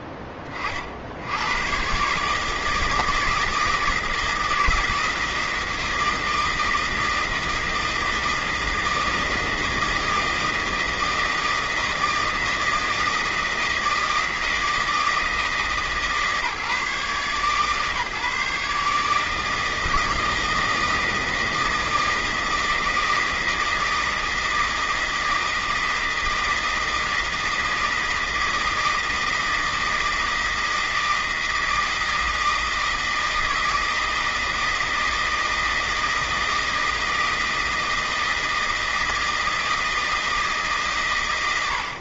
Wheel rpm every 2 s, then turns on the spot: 30, 160, 170, 160, 160, 160, 160, 160, 150, 150, 160, 160, 160, 160, 160, 160, 160, 160, 160, 160, 160.
none